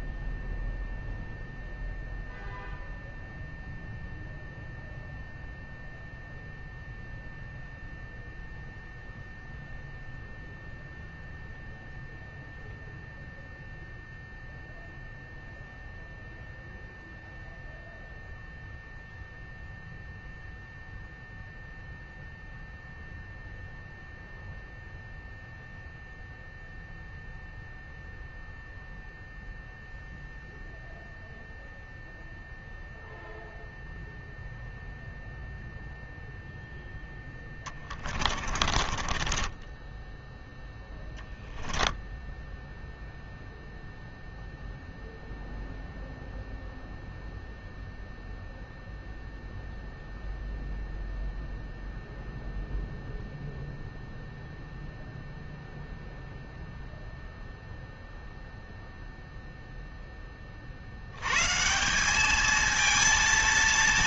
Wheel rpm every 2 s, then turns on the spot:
0, 0, 0, 0, 0, 0, 0, 0, 0, 0, 0, 0, 0, 0, 0, 0, 0, 0, 10, 30, 10, 0, 0, 0, 0, 0, 0, 0, 0, 0, 80, 220.
38-40